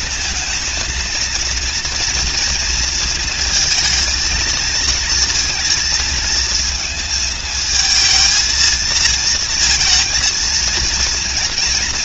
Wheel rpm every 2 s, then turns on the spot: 230, 230, 230, 220, 220, 220.
none